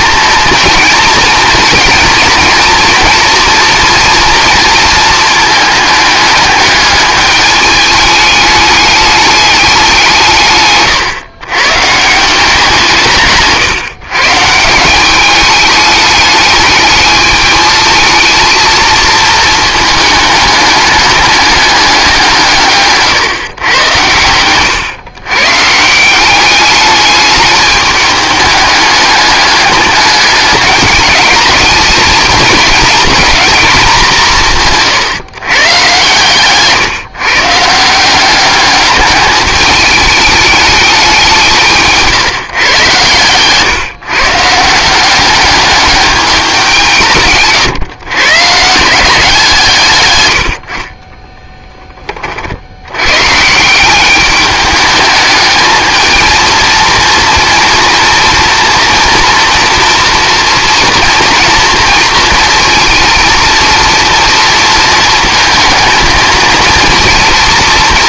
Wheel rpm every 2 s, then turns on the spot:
230, 230, 230, 210, 210, 130, 170, 170, 210, 220, 210, 150, 110, 200, 210, 210, 230, 150, 140, 200, 200, 130, 160, 180, 160, 50, 70, 210, 230, 230, 230, 230, 230, 230.
10-12 34-36 50-52